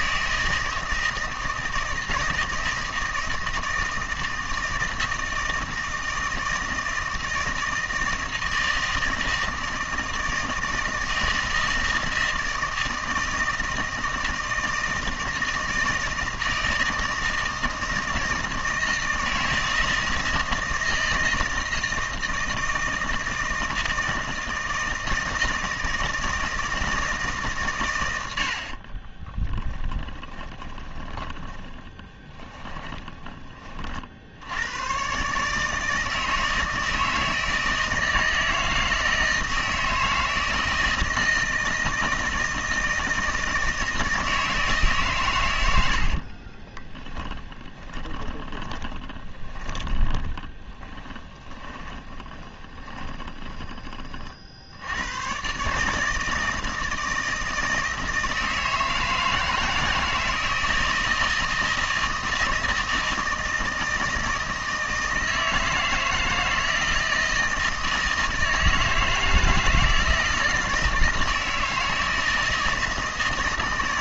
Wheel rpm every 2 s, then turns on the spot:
160, 160, 160, 160, 160, 160, 160, 160, 160, 160, 160, 160, 160, 160, 40, 20, 10, 110, 160, 160, 160, 160, 150, 20, 20, 20, 20, 70, 160, 160, 160, 160, 160, 160, 160, 160, 160.
28-34 46-54